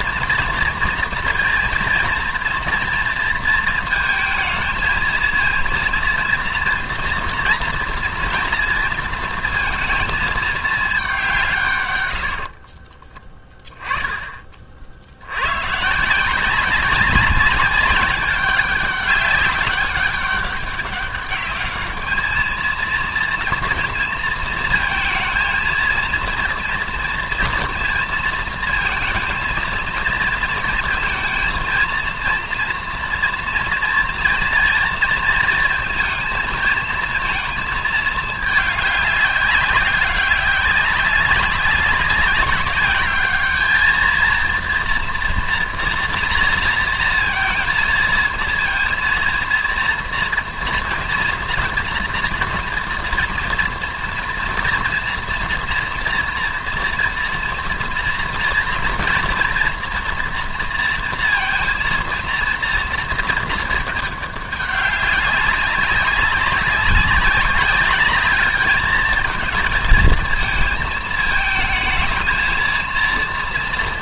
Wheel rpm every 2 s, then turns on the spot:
230, 230, 230, 230, 230, 200, 20, 70, 200, 200, 200, 230, 220, 230, 230, 230, 230, 230, 220, 200, 190, 210, 230, 230, 230, 220, 230, 240, 230, 230, 230, 230, 200, 190, 220, 220, 230.
none